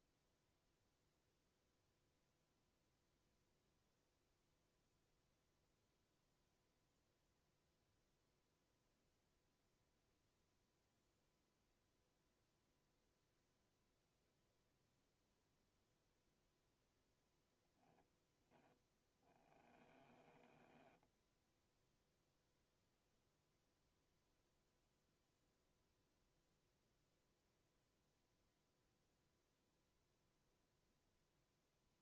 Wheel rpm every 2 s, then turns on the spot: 0, 0, 0, 0, 0, 0, 0, 0, 0, 20, 10, 0, 0, 0, 0, 0.
18-22